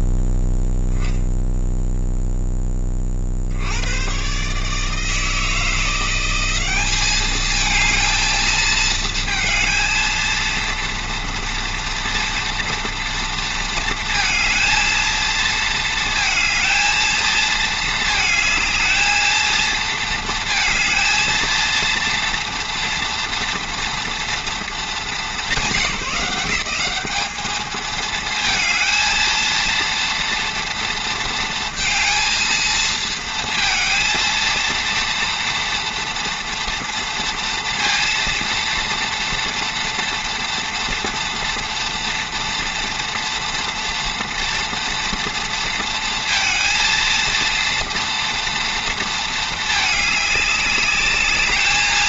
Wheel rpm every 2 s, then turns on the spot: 0, 30, 160, 210, 220, 230, 230, 230, 220, 220, 230, 230, 210, 190, 220, 230, 220, 230, 230, 230, 230, 230, 230, 230, 230, 210.
none